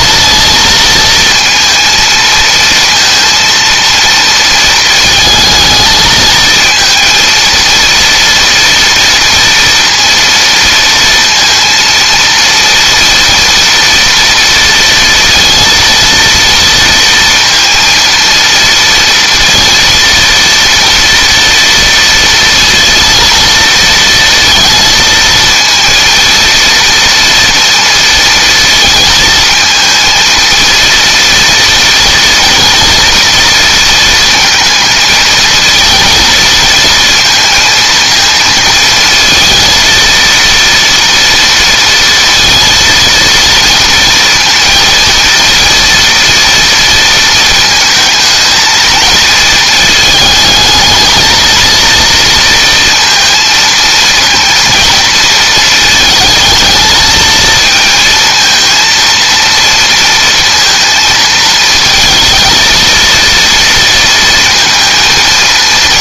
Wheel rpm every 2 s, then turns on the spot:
230, 230, 230, 230, 230, 230, 230, 230, 230, 230, 230, 230, 220, 230, 230, 230, 230, 230, 230, 220, 230, 230, 230, 230, 230, 220, 230, 230, 220, 230, 230, 230, 230.
none